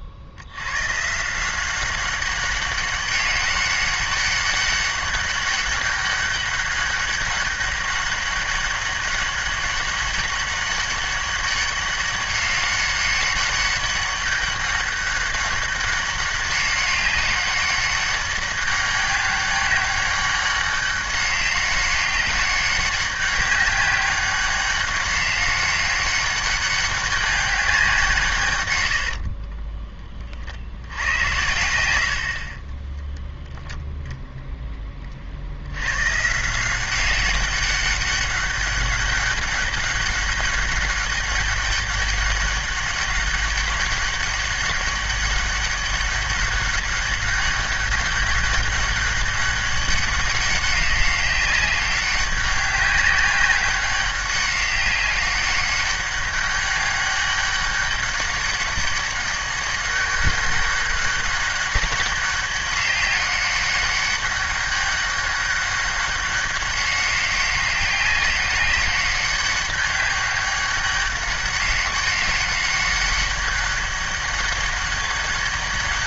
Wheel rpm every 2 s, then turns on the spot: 100, 200, 200, 200, 200, 200, 200, 200, 200, 200, 200, 200, 190, 200, 130, 70, 30, 10, 170, 200, 200, 200, 200, 200, 200, 190, 190, 200, 200, 190, 200, 200, 200, 200, 200, 200, 200, 200.
32-34